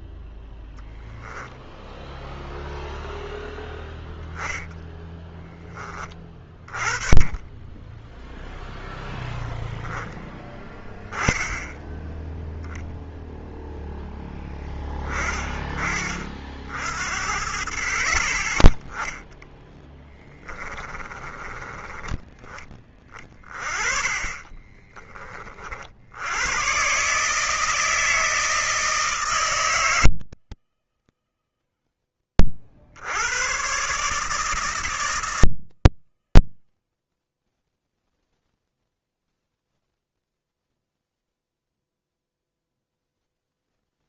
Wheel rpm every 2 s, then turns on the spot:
10, 0, 10, 20, 0, 20, 0, 20, 50, 10, 30, 20, 20, 140, 160, 130, 60, 160, 50, 0, 0, 0.
4-8 20-22